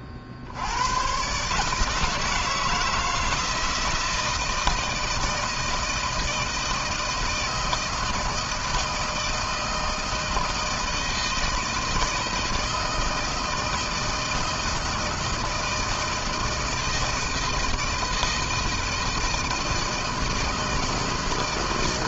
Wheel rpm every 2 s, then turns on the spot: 70, 160, 160, 160, 160, 160, 160, 160, 160, 160, 160.
none